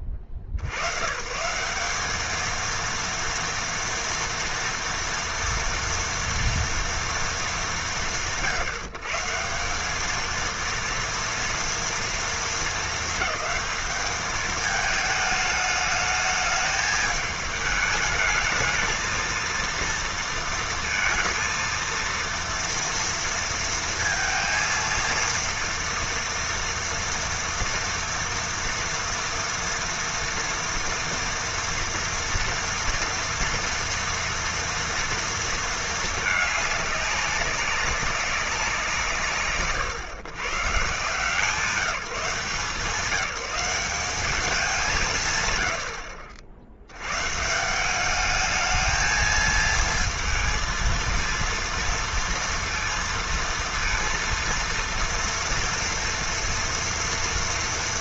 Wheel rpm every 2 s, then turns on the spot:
70, 230, 230, 230, 140, 230, 210, 210, 220, 220, 230, 230, 230, 230, 230, 230, 230, 230, 200, 150, 140, 180, 170, 90, 220, 230, 230, 230, 230.
none